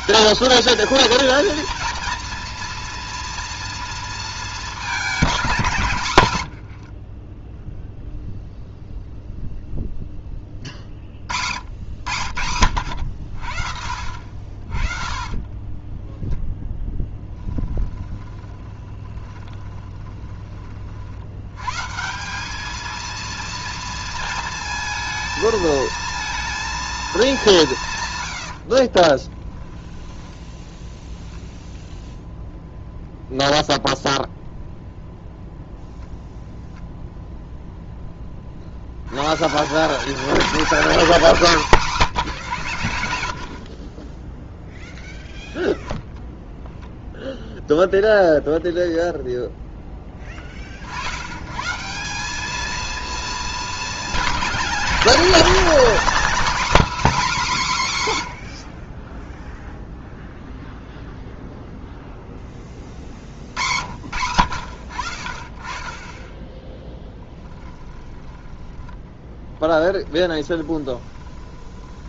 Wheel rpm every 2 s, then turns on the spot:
210, 230, 210, 60, 0, 40, 80, 60, 20, 20, 40, 210, 220, 230, 50, 10, 0, 0, 0, 60, 200, 90, 0, 0, 0, 40, 220, 210, 260, 50, 0, 30, 60, 10, 10, 30.
6-8 14-20 28-30 70-72